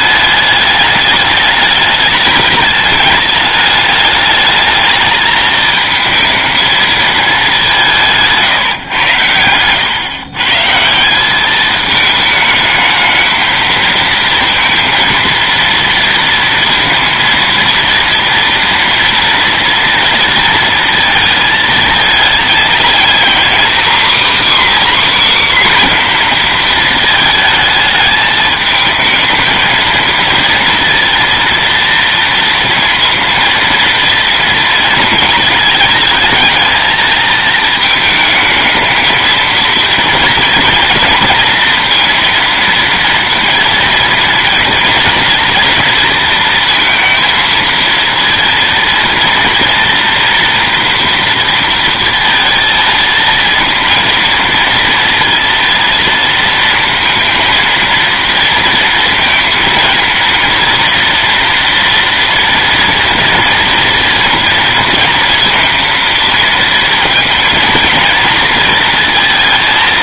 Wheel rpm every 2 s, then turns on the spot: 210, 210, 220, 220, 120, 180, 220, 230, 230, 230, 230, 240, 280, 220, 220, 230, 230, 220, 220, 220, 230, 230, 230, 230, 230, 230, 230, 230, 230, 230, 230, 230, 230, 230, 230.
none